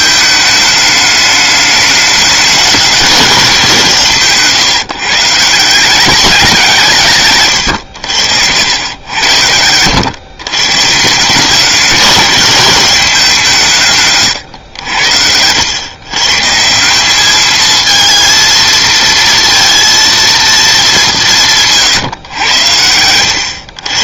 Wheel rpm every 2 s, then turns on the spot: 210, 210, 140, 180, 90, 130, 200, 110, 160, 230, 220, 110.
none